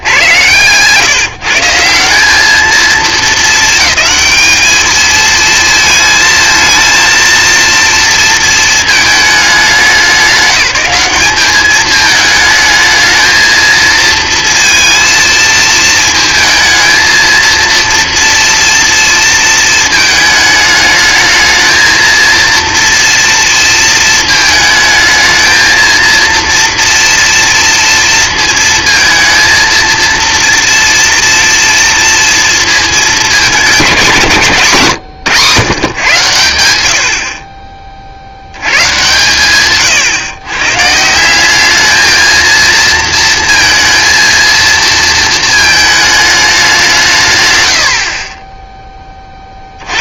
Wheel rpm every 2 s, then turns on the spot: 130, 210, 220, 230, 220, 200, 220, 230, 220, 230, 220, 230, 220, 230, 220, 230, 230, 170, 100, 110, 140, 230, 230, 200, 10.
none